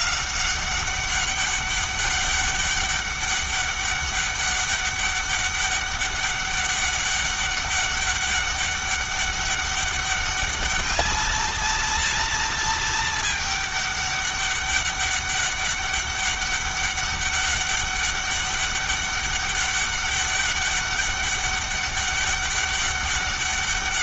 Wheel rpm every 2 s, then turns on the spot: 190, 200, 200, 200, 200, 210, 220, 200, 200, 200, 200, 200.
none